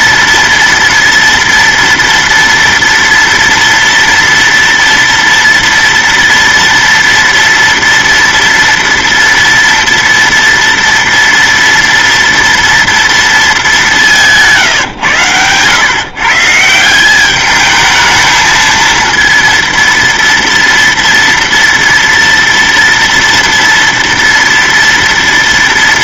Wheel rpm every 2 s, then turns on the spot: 230, 230, 230, 230, 230, 230, 230, 140, 170, 230, 230, 230, 230.
none